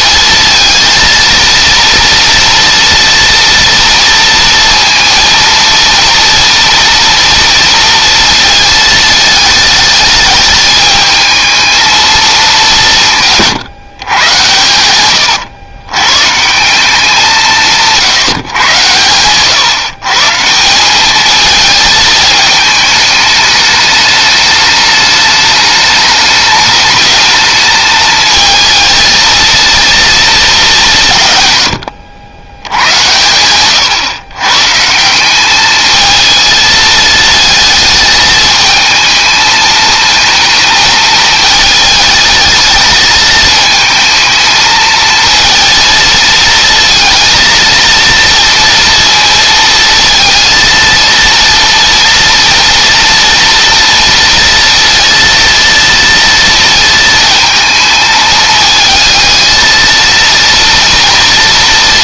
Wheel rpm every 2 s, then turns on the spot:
230, 230, 230, 230, 220, 220, 170, 110, 180, 120, 200, 210, 210, 210, 230, 180, 80, 170, 220, 220, 220, 220, 220, 230, 230, 230, 230, 230, 230, 220, 230.
14-16